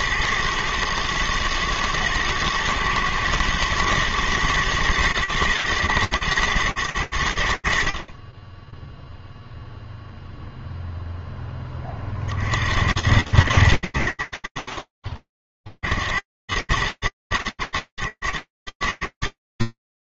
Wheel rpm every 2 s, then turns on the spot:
110, 120, 110, 110, 20, 0, 60, 100, 40, 100.
none